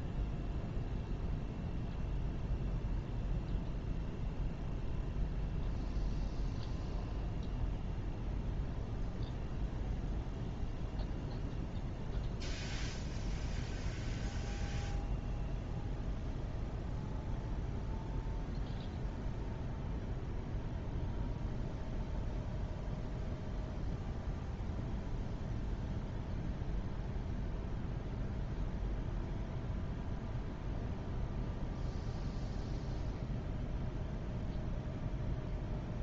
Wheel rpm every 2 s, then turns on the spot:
0, 0, 0, 0, 0, 0, 0, 0, 0, 0, 0, 0, 0, 0, 0, 0, 0, 0.
none